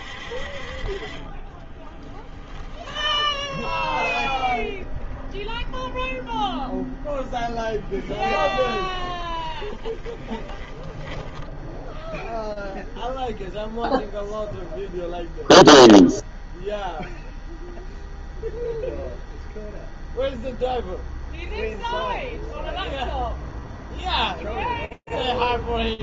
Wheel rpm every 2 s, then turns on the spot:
20, 10, 0, 10, 20, 10, 0, 0, 0, 0, 0, 0, 0.
0-4 8-12